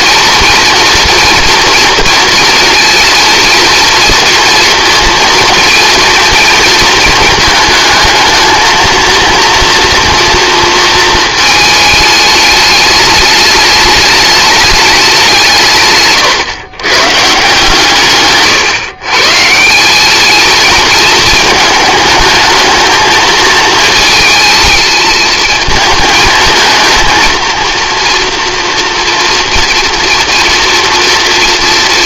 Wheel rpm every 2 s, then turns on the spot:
230, 230, 230, 220, 220, 230, 210, 210, 130, 140, 230, 220, 220, 220, 240, 230.
none